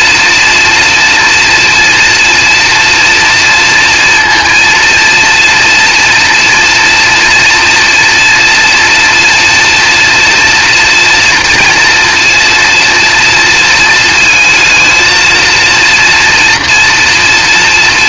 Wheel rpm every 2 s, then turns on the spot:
230, 230, 230, 230, 230, 230, 230, 230, 230.
none